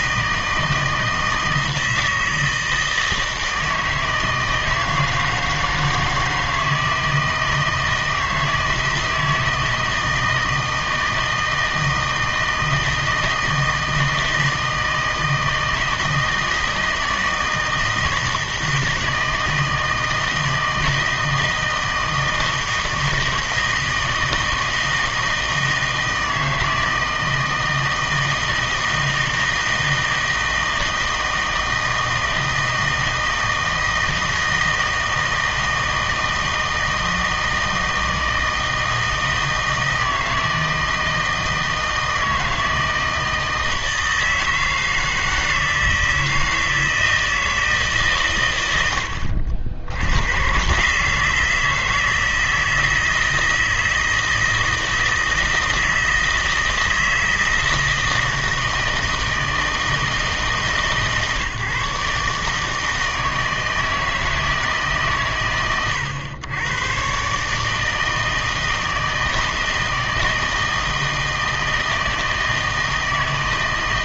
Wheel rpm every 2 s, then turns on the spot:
160, 160, 160, 160, 160, 160, 160, 160, 160, 160, 160, 160, 160, 160, 160, 160, 160, 160, 160, 160, 160, 160, 160, 160, 100, 130, 160, 160, 160, 160, 150, 150, 150, 120, 160, 160, 160.
none